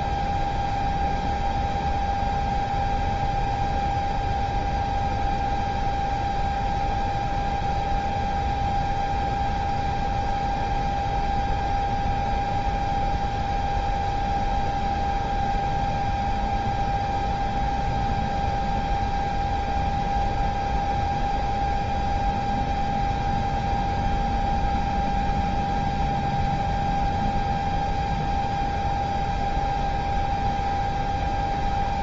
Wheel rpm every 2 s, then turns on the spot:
0, 0, 0, 0, 0, 0, 0, 0, 0, 0, 0, 0, 0, 0, 0, 0.
none